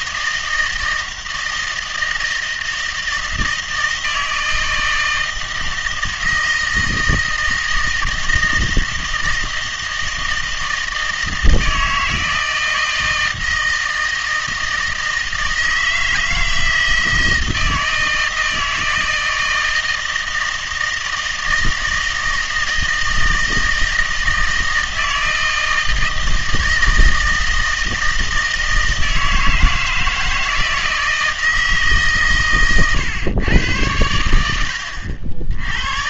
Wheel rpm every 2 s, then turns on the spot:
160, 160, 160, 160, 160, 160, 160, 160, 160, 160, 160, 160, 160, 160, 160, 160, 130, 90.
none